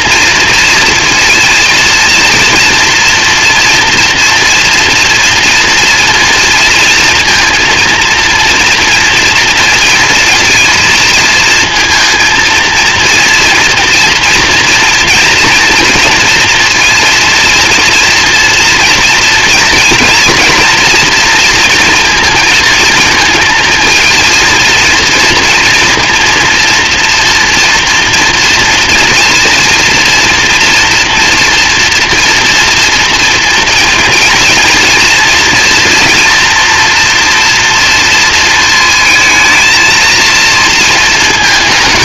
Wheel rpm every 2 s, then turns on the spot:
230, 230, 230, 230, 230, 230, 230, 230, 230, 230, 230, 230, 230, 240, 230, 230, 230, 230, 240, 230, 230.
none